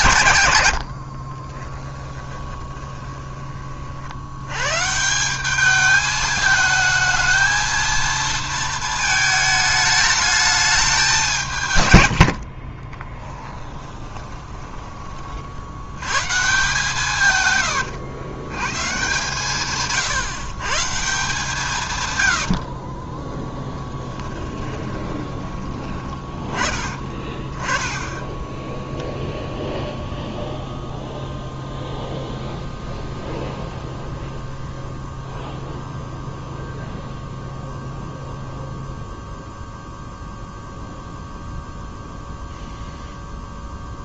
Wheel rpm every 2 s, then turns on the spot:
70, 20, 150, 220, 220, 200, 20, 20, 150, 130, 160, 30, 20, 20, 0, 0, 0, 0, 0, 0, 0, 0.
0-4 12-14 24-26